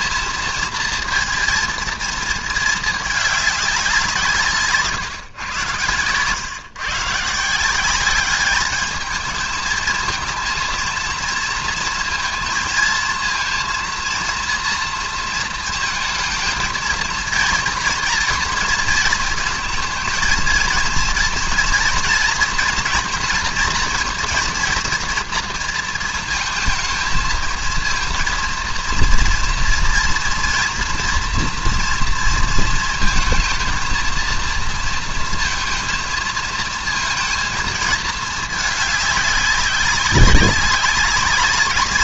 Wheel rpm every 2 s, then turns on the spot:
230, 220, 150, 140, 220, 230, 230, 230, 220, 230, 230, 240, 230, 230, 230, 230, 230, 230, 230, 210, 200.
none